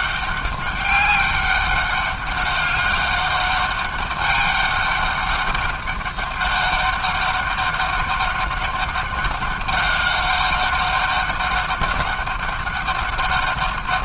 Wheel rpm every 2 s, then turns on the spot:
200, 200, 200, 200, 200, 200, 200.
none